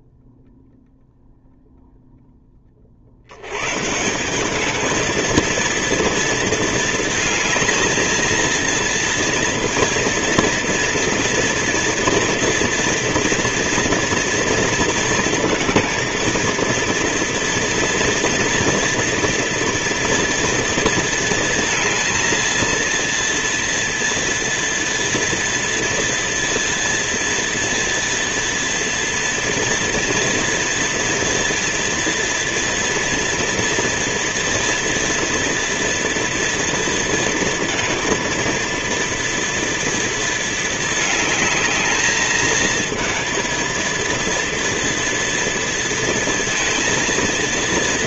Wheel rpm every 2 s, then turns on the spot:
0, 20, 200, 220, 230, 230, 230, 230, 230, 230, 230, 230, 230, 230, 230, 230, 230, 230, 230, 230, 220, 220, 230, 230.
none